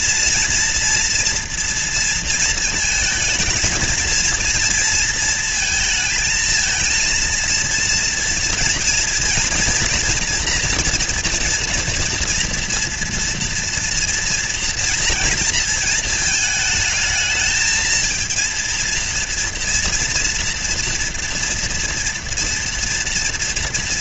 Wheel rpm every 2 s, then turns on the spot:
240, 230, 230, 230, 230, 240, 240, 230, 220, 230, 230, 230.
none